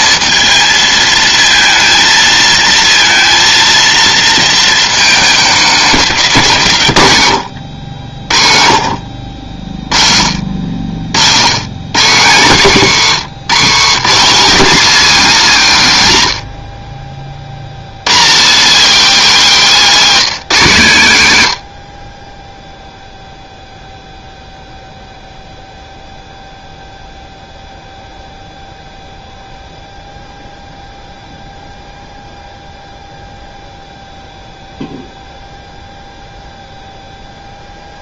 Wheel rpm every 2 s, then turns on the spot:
220, 220, 220, 120, 60, 70, 150, 240, 60, 230, 180, 0, 0, 0, 0, 0, 0, 0, 0.
none